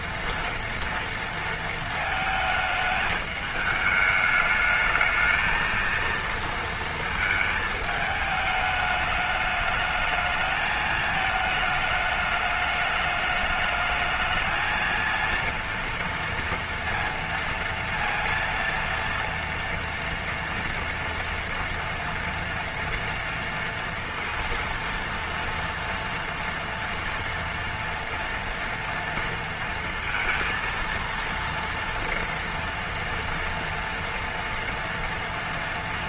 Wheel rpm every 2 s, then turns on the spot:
230, 220, 210, 230, 210, 220, 210, 220, 230, 230, 230, 230, 230, 230, 230, 230, 230, 230.
none